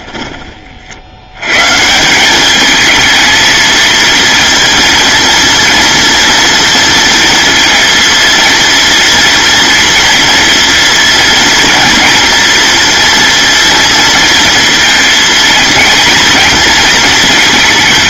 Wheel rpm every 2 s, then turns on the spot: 70, 220, 230, 230, 230, 230, 230, 230, 230.
none